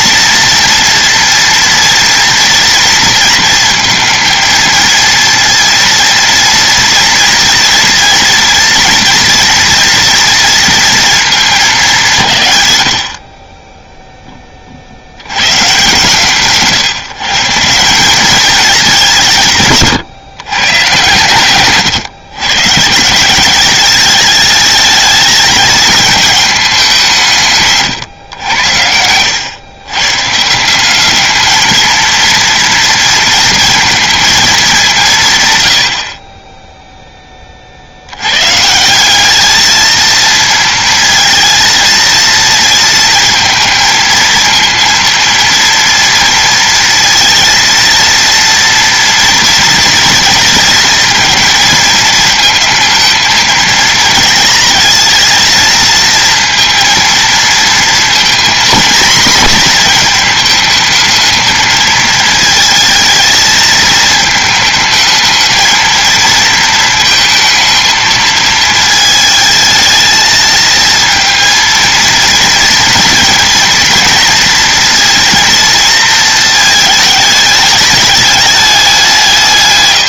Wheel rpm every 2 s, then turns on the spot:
230, 230, 230, 230, 230, 230, 90, 60, 150, 200, 120, 150, 210, 190, 100, 180, 230, 190, 0, 170, 230, 230, 230, 230, 230, 230, 230, 220, 230, 230, 220, 220, 220, 220, 220, 230, 230, 230, 220, 200.
none